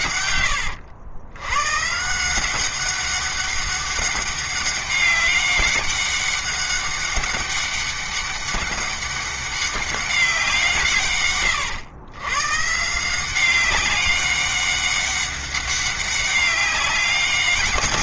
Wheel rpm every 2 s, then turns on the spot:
90, 190, 200, 200, 200, 160, 150, 200, 200.
none